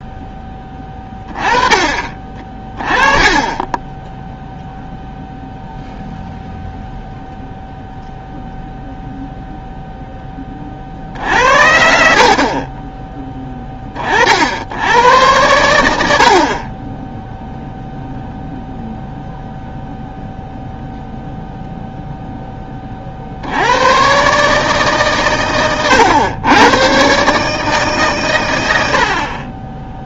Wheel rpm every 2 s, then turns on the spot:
20, 20, 0, 0, 0, 50, 20, 90, 20, 0, 0, 30, 140, 110, 80.
10-14